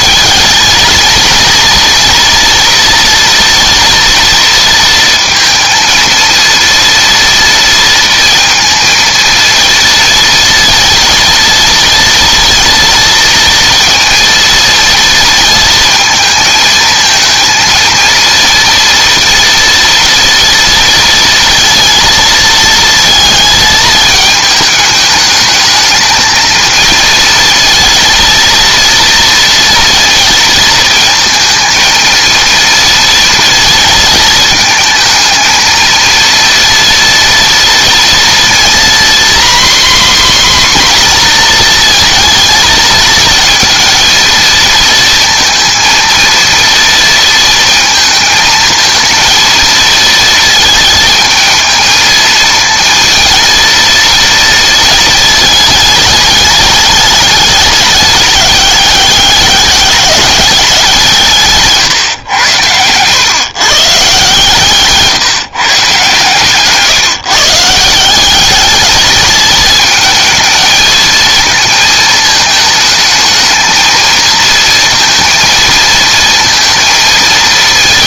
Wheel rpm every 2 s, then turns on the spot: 230, 240, 230, 230, 230, 230, 230, 230, 230, 230, 230, 220, 220, 230, 230, 230, 230, 230, 230, 240, 260, 220, 230, 230, 220, 220, 230, 230, 210, 200, 180, 100, 140, 150, 210, 220, 220, 230, 230.
none